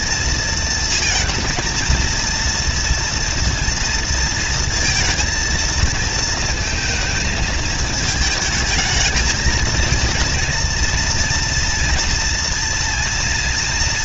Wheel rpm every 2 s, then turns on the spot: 230, 230, 230, 230, 220, 230, 230.
none